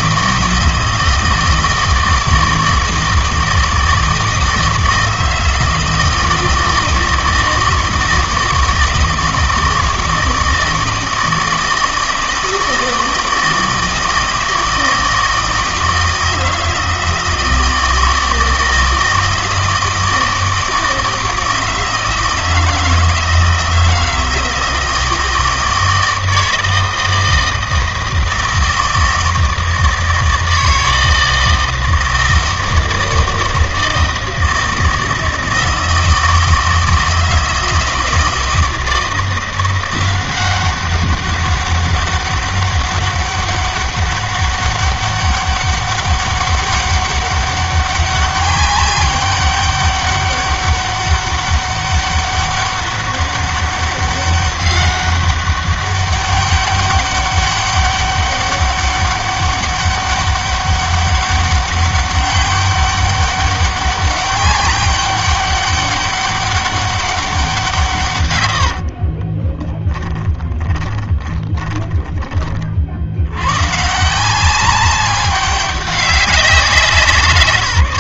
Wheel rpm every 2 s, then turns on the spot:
160, 160, 160, 160, 160, 160, 160, 160, 160, 160, 160, 160, 160, 160, 160, 160, 160, 160, 160, 160, 190, 200, 200, 200, 200, 200, 200, 200, 200, 200, 200, 200, 200, 200, 60, 20, 40, 190, 180.
68-72